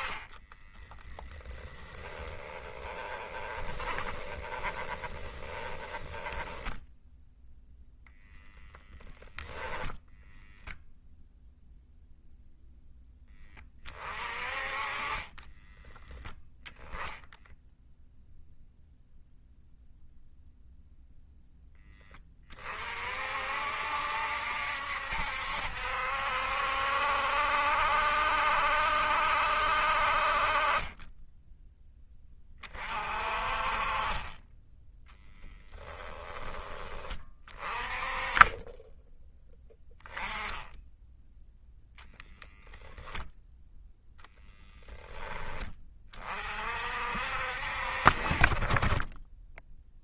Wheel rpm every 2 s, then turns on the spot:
20, 10, 30, 20, 0, 0, 10, 30, 0, 0, 0, 40, 70, 70, 70, 30, 40, 10, 30, 10, 10, 0, 20, 50, 30.
0-8